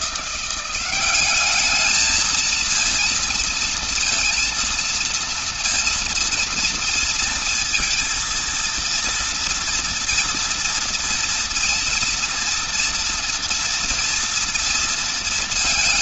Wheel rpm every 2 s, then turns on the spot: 180, 220, 230, 230, 230, 230, 230, 230.
none